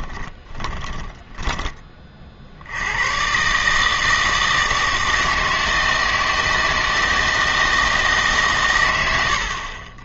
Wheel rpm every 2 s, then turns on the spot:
10, 70, 160, 160, 120.
0-2